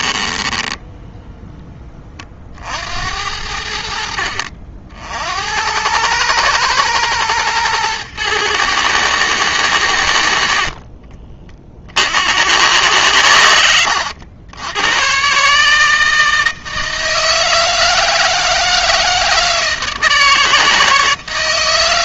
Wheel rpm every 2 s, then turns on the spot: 10, 70, 60, 120, 110, 40, 100, 110, 160, 160, 160.
0-2 10-12